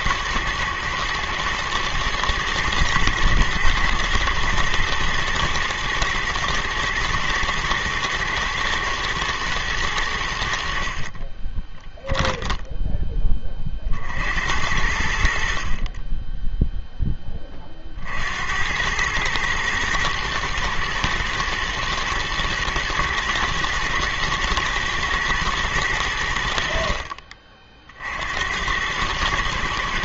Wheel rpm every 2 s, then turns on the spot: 110, 110, 120, 110, 110, 60, 10, 80, 10, 80, 120, 120, 110, 60, 100.
none